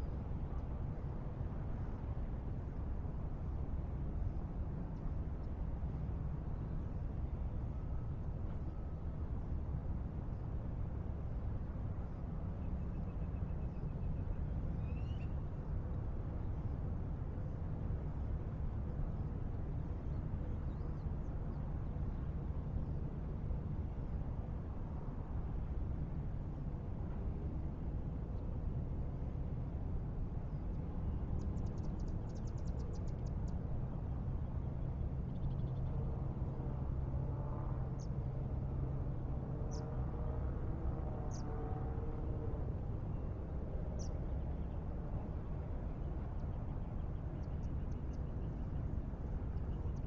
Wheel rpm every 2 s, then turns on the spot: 0, 0, 0, 0, 0, 0, 0, 0, 0, 0, 0, 0, 0, 0, 0, 0, 0, 0, 0, 0, 0, 0, 0, 0, 0.
none